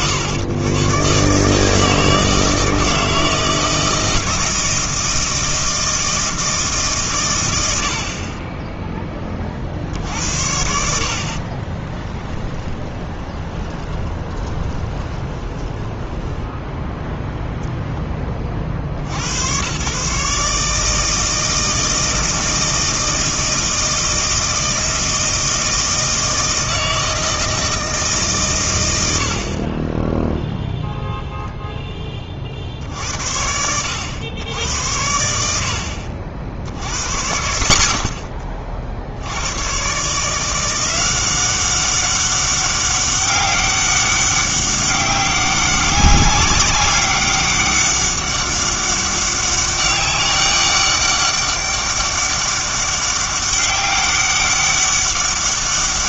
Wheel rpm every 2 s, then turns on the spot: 110, 160, 160, 150, 10, 70, 20, 20, 10, 50, 150, 160, 160, 160, 120, 0, 60, 80, 80, 40, 170, 200, 200, 200, 200, 200, 200, 200.
12-18